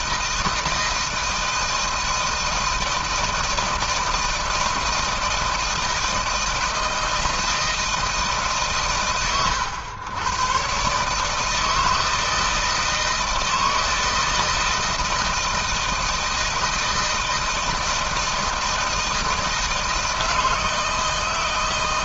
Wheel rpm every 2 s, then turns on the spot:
160, 160, 160, 160, 130, 130, 160, 160, 160, 160, 160.
none